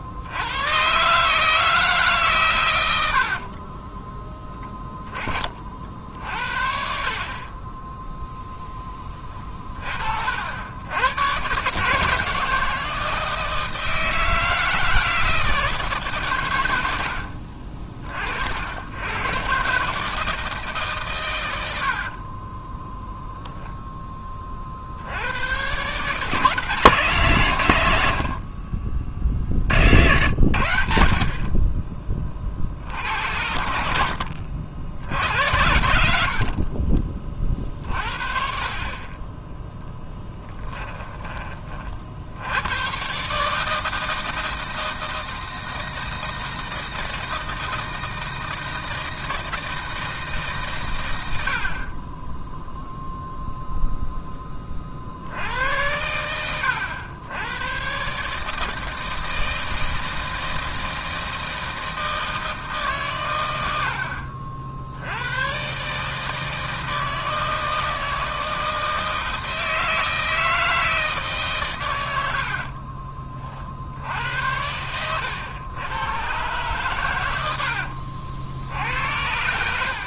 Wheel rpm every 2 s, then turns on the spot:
130, 100, 10, 50, 10, 100, 170, 160, 90, 80, 150, 10, 50, 160, 30, 80, 60, 70, 30, 40, 20, 110, 160, 160, 160, 130, 0, 20, 80, 160, 160, 150, 70, 160, 160, 160, 50, 90, 130, 80.
22-24 36-38 40-42 72-74